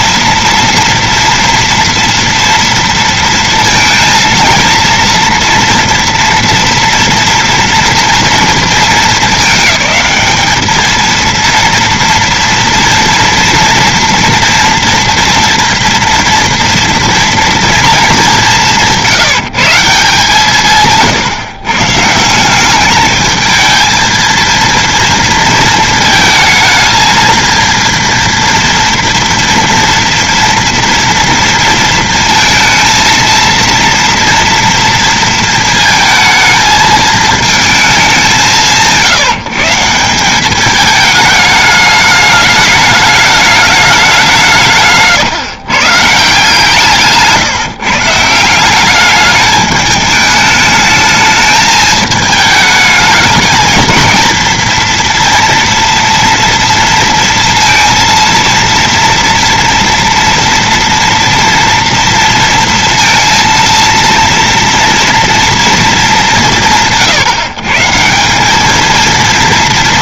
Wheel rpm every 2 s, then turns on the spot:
230, 230, 230, 230, 230, 210, 230, 230, 230, 210, 160, 160, 220, 220, 230, 230, 230, 230, 220, 200, 180, 210, 190, 150, 160, 210, 210, 230, 240, 230, 230, 230, 230, 200, 170.
none